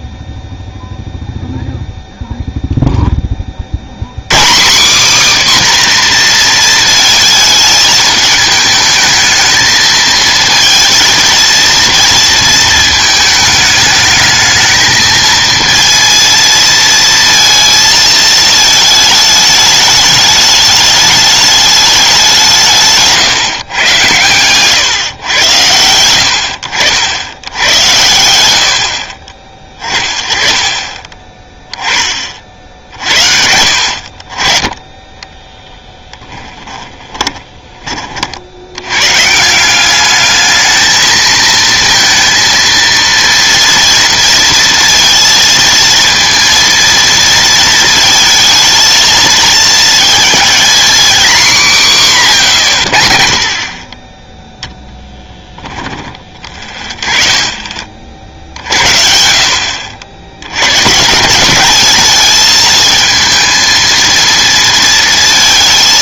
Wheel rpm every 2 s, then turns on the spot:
0, 0, 190, 230, 220, 230, 230, 220, 230, 220, 210, 170, 130, 70, 80, 30, 50, 30, 20, 80, 220, 230, 230, 230, 220, 230, 140, 0, 30, 50, 110, 220, 230.
24-26 36-38